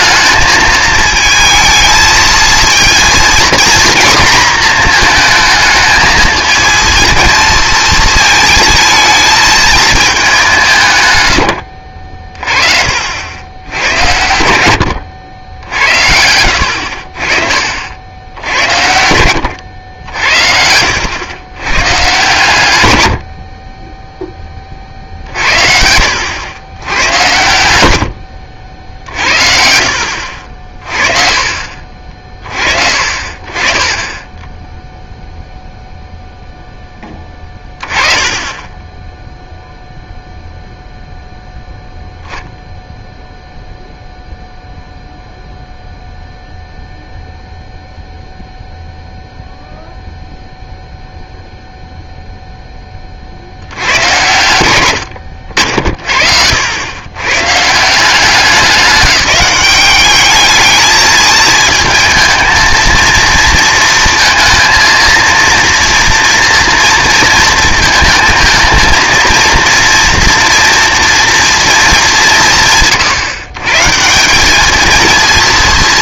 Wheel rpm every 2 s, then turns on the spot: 220, 230, 240, 220, 220, 180, 40, 90, 70, 70, 70, 120, 30, 110, 70, 50, 40, 10, 10, 20, 0, 0, 0, 0, 0, 0, 10, 110, 80, 180, 220, 230, 220, 230, 230, 240, 160, 200.
30-36